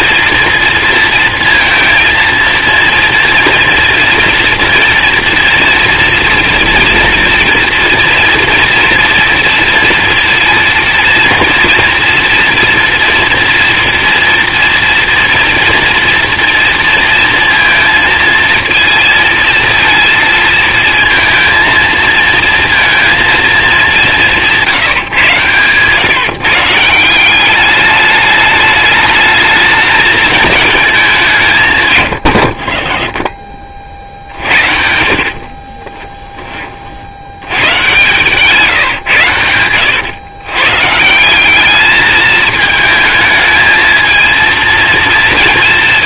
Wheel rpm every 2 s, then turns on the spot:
230, 230, 230, 230, 230, 230, 240, 240, 230, 230, 230, 210, 120, 200, 220, 160, 40, 40, 100, 100, 180, 220, 190.
24-26 34-36